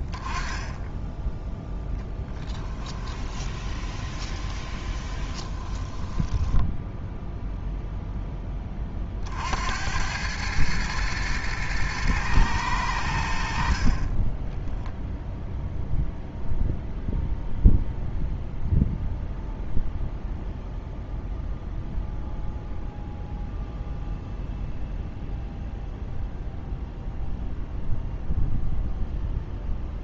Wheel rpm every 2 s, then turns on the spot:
10, 10, 20, 10, 10, 100, 110, 20, 0, 0, 0, 0, 0, 0, 0.
2-8